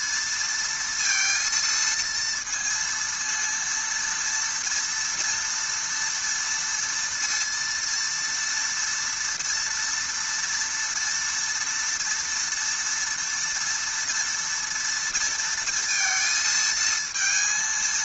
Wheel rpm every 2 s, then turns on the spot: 230, 230, 230, 230, 230, 240, 230, 230, 230.
none